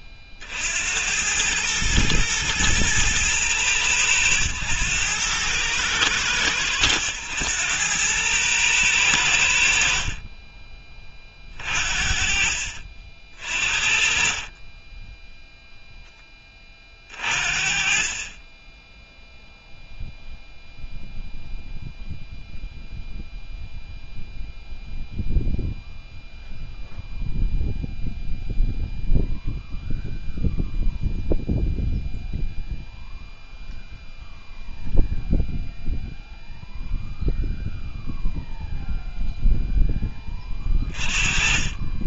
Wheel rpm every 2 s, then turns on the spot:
60, 110, 100, 100, 110, 20, 50, 30, 20, 20, 0, 0, 0, 0, 0, 0, 0, 0, 0, 0, 30.
10-12